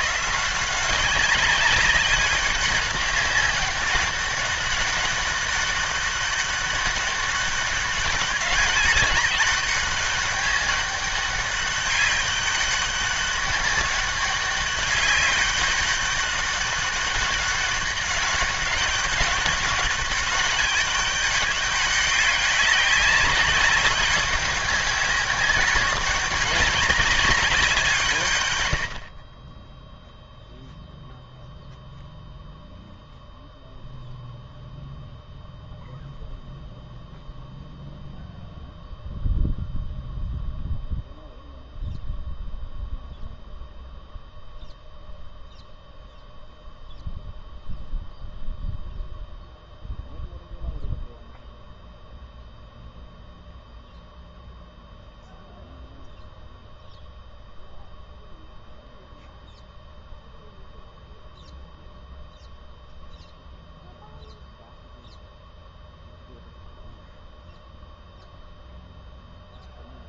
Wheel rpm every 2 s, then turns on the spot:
170, 200, 200, 200, 190, 200, 200, 190, 200, 200, 200, 190, 200, 200, 120, 0, 0, 0, 0, 0, 0, 0, 0, 0, 0, 0, 0, 0, 0, 0, 0, 0, 0, 0, 0.
none